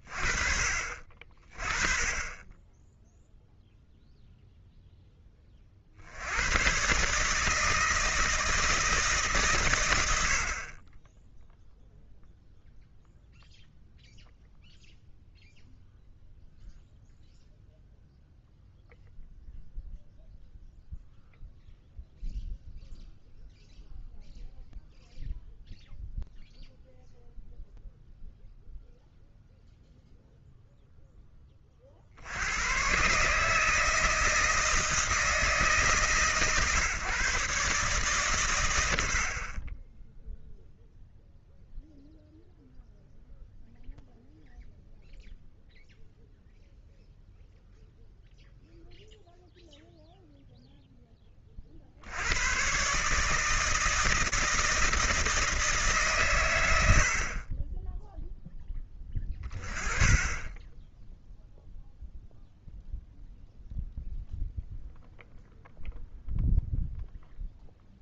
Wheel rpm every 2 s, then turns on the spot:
30, 0, 30, 150, 150, 10, 0, 0, 0, 0, 0, 0, 0, 0, 0, 10, 150, 160, 140, 70, 0, 0, 0, 0, 0, 10, 150, 160, 70, 20, 20, 0, 0, 0.
none